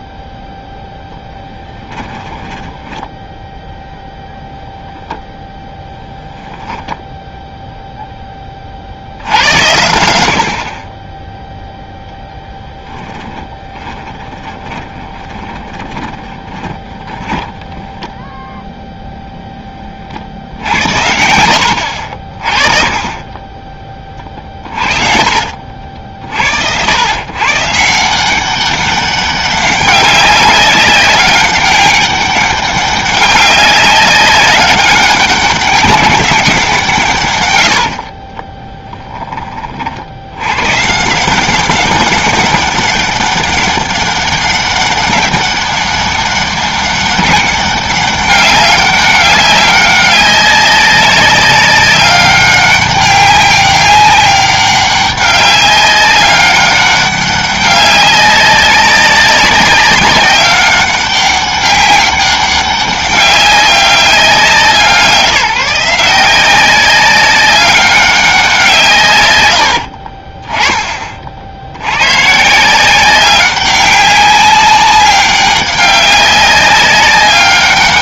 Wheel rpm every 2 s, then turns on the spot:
0, 10, 0, 10, 50, 40, 10, 30, 20, 0, 70, 30, 30, 90, 190, 200, 200, 190, 170, 10, 120, 200, 200, 200, 200, 190, 200, 200, 200, 200, 190, 200, 180, 190, 160, 20, 170, 200, 190.
2-4 12-18 20-22 38-40 70-72